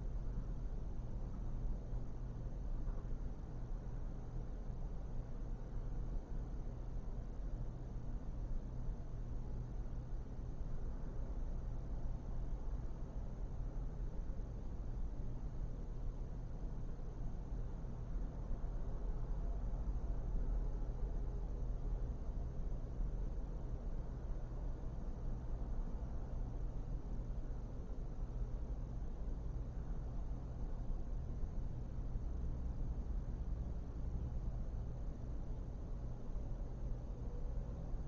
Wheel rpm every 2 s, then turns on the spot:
0, 0, 0, 0, 0, 0, 0, 0, 0, 0, 0, 0, 0, 0, 0, 0, 0, 0, 0.
none